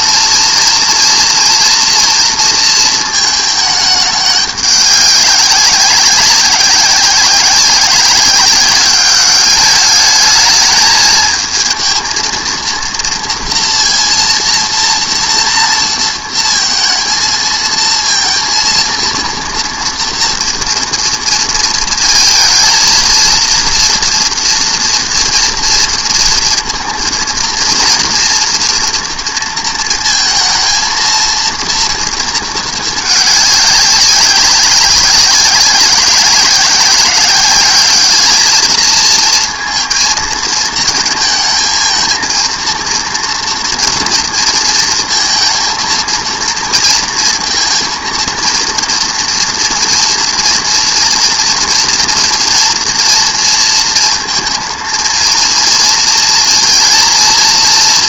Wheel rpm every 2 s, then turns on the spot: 230, 230, 200, 190, 190, 220, 230, 230, 230, 230, 230, 230, 230, 230, 230, 220, 220, 190, 190, 220, 220, 230, 230, 230, 230, 240, 230, 230, 230.
none